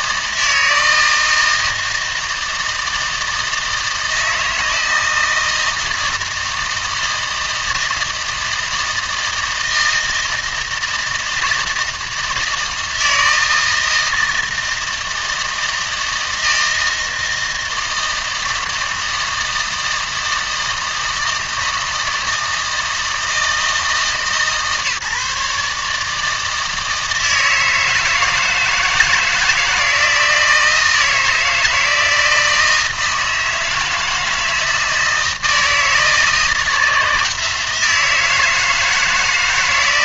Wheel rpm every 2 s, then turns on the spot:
160, 160, 160, 160, 160, 160, 160, 160, 160, 160, 160, 160, 150, 160, 160, 160, 160, 160, 160, 160.
none